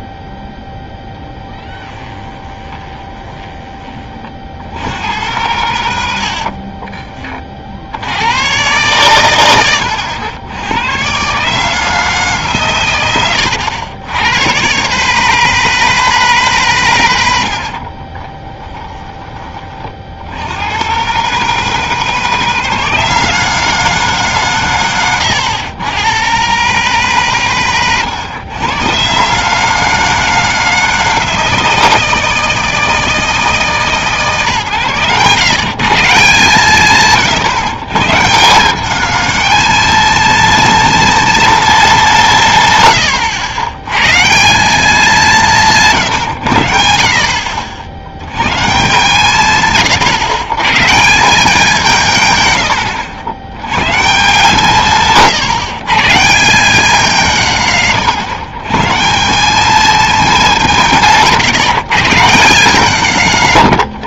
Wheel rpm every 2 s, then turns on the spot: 10, 20, 70, 40, 120, 100, 140, 110, 140, 20, 110, 160, 140, 130, 110, 160, 160, 140, 150, 180, 230, 150, 170, 90, 150, 130, 120, 160, 180, 150, 180, 170.
2-4 6-8 18-20